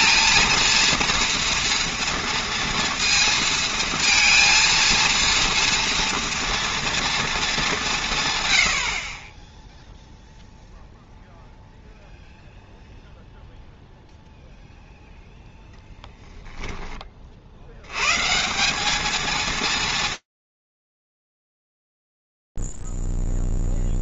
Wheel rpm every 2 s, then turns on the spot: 230, 230, 230, 230, 60, 0, 0, 0, 20, 200, 40, 0.
none